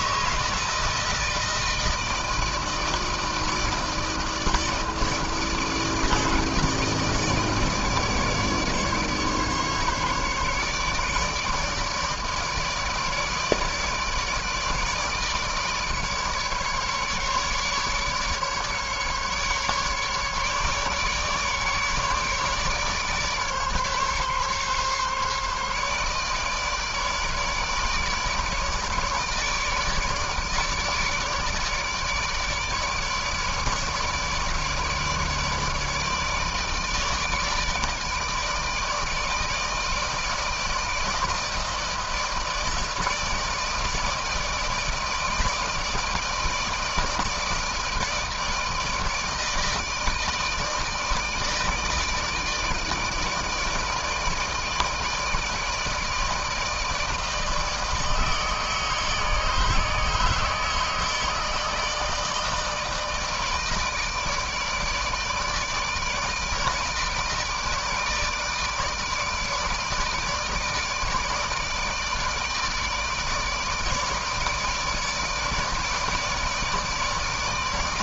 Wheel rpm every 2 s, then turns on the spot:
160, 160, 160, 160, 150, 150, 150, 150, 150, 150, 140, 150, 140, 150, 150, 150, 150, 150, 150, 160, 160, 160, 160, 160, 160, 160, 160, 160, 160, 160, 160, 160, 160, 160, 150, 150, 160, 160, 160.
none